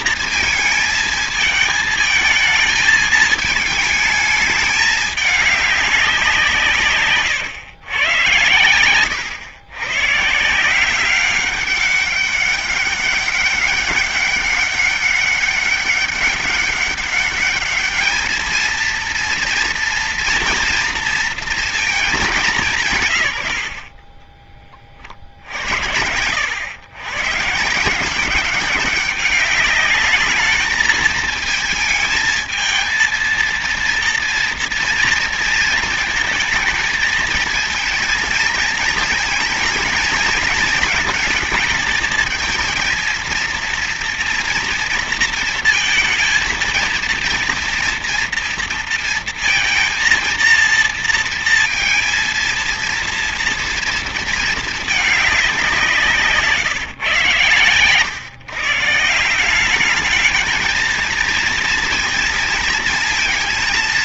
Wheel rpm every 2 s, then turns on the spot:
230, 220, 210, 170, 110, 150, 200, 200, 200, 220, 230, 190, 30, 90, 180, 220, 220, 230, 220, 220, 220, 230, 230, 230, 230, 230, 230, 220, 150, 120, 210, 230.
none